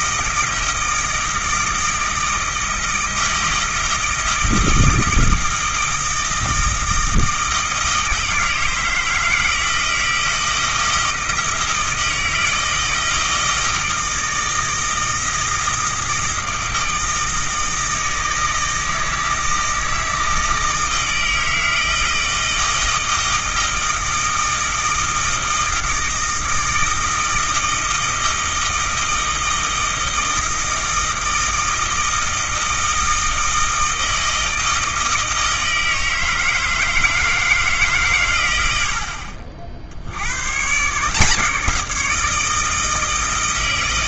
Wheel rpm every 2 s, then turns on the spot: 160, 160, 160, 160, 160, 160, 160, 160, 160, 160, 160, 160, 160, 160, 160, 160, 160, 160, 160, 90, 130, 160.
none